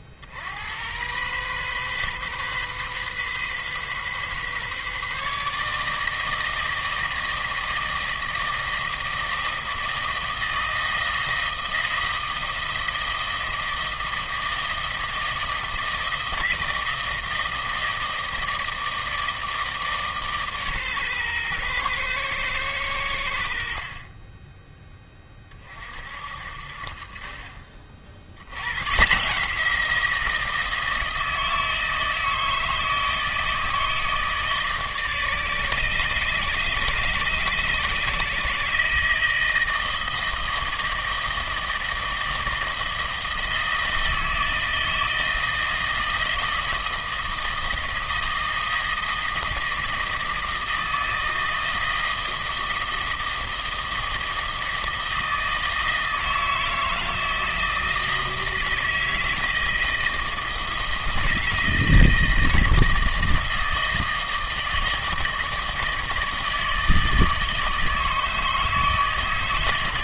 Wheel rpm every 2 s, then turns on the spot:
90, 130, 140, 160, 160, 160, 160, 160, 160, 160, 140, 100, 10, 50, 120, 160, 160, 150, 130, 150, 160, 160, 160, 160, 160, 160, 160, 160, 160, 160, 160, 160, 160, 160, 160.
none